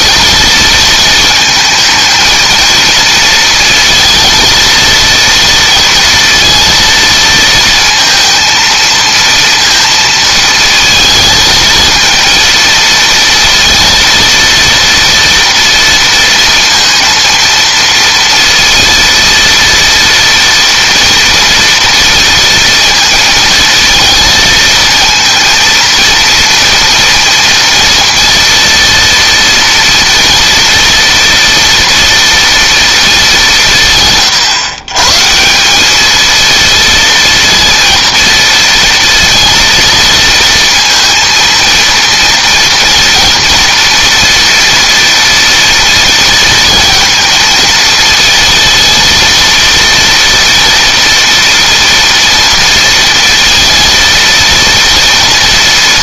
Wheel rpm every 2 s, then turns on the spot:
220, 230, 230, 230, 230, 220, 230, 230, 230, 230, 230, 230, 230, 230, 230, 230, 210, 140, 230, 230, 230, 230, 230, 230, 230, 240, 230, 230.
none